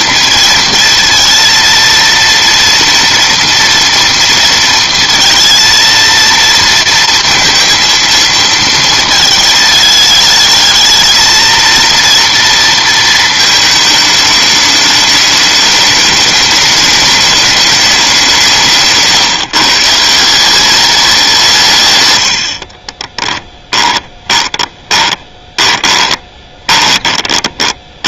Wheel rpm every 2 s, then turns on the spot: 230, 230, 230, 230, 230, 220, 230, 210, 210, 160, 190, 50, 20, 20.
22-28